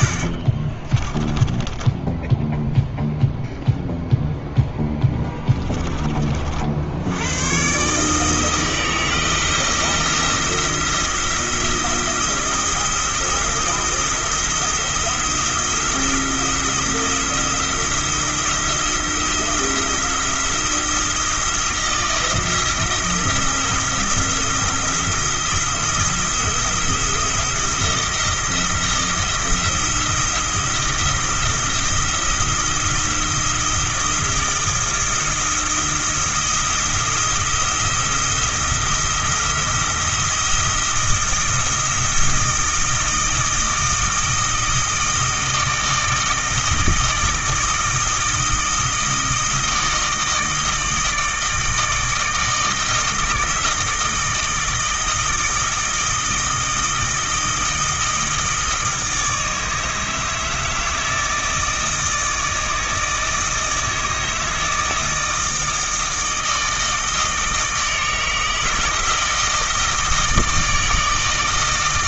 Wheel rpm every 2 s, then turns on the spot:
20, 0, 10, 70, 160, 170, 170, 170, 170, 170, 170, 160, 170, 160, 170, 170, 170, 170, 170, 170, 170, 160, 160, 160, 160, 160, 160, 160, 160, 160, 160, 160, 160, 160, 160, 160.
0-2 4-6